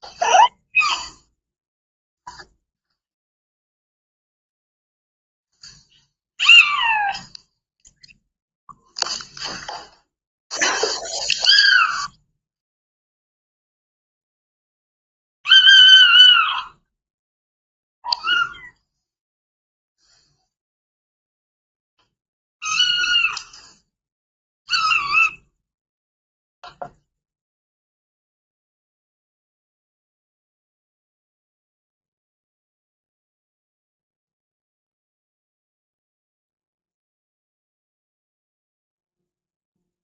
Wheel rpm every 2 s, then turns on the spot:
0, 0, 0, 0, 0, 0, 0, 0, 0, 0, 0, 0, 0, 0, 0, 0, 0, 0, 0, 0.
none